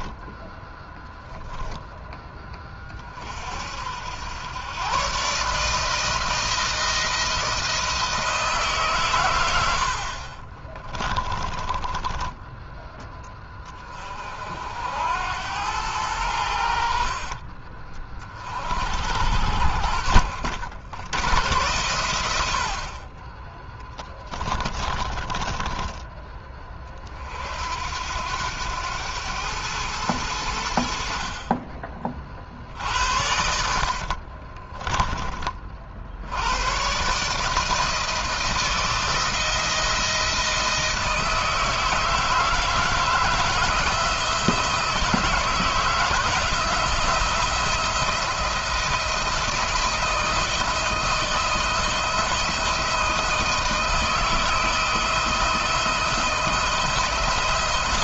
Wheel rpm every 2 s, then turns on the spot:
10, 30, 110, 160, 140, 20, 10, 70, 60, 60, 70, 50, 20, 40, 100, 70, 70, 30, 120, 160, 160, 160, 160, 170, 170, 160, 160, 160, 170.
10-12 22-26 32-36